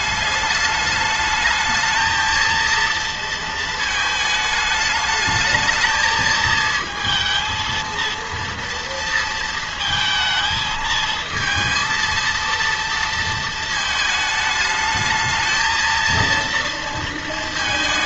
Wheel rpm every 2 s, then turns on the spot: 200, 230, 220, 220, 230, 220, 230, 220, 230.
none